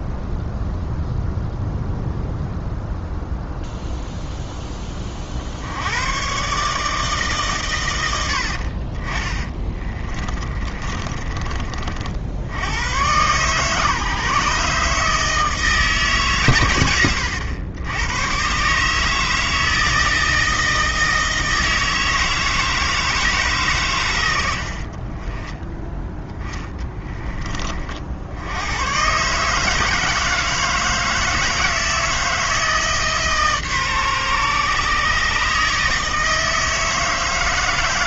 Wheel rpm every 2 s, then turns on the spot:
0, 0, 10, 150, 50, 20, 100, 150, 110, 140, 160, 160, 50, 10, 100, 160, 160, 140, 160.
10-12